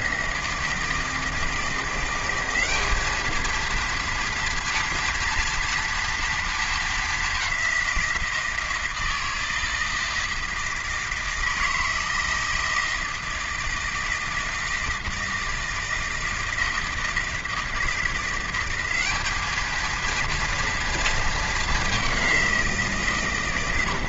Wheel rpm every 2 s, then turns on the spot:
160, 190, 230, 220, 160, 160, 160, 160, 160, 190, 230, 170.
none